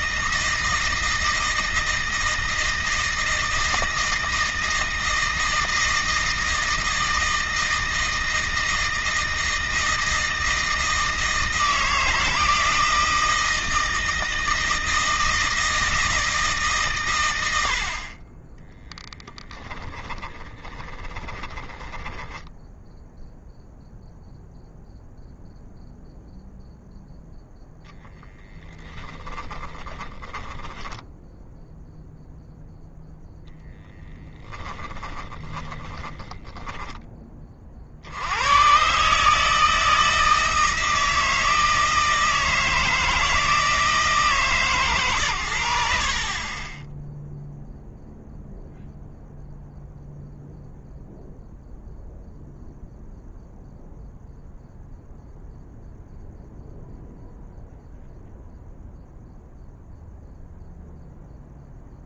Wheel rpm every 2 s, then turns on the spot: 160, 160, 160, 160, 160, 160, 160, 160, 130, 10, 30, 0, 0, 0, 10, 10, 0, 20, 20, 130, 160, 160, 120, 10, 0, 0, 0, 0, 0, 0, 0.
18-22 28-32 34-36